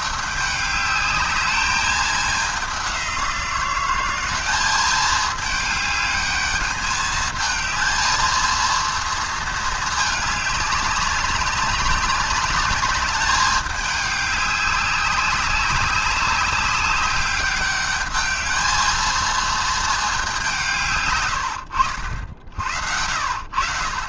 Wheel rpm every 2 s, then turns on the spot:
200, 190, 200, 210, 230, 200, 200, 200, 200, 220, 150, 80.
none